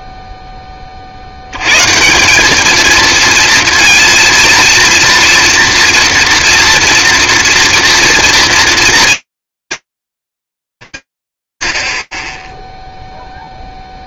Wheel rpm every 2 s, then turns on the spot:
0, 180, 230, 230, 230, 200, 0.
none